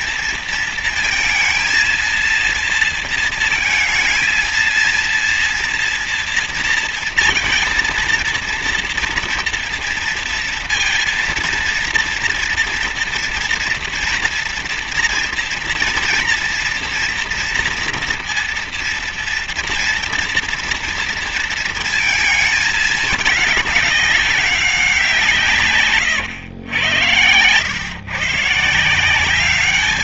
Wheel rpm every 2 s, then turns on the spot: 230, 230, 230, 230, 230, 230, 240, 230, 230, 230, 230, 220, 190, 110, 160.
none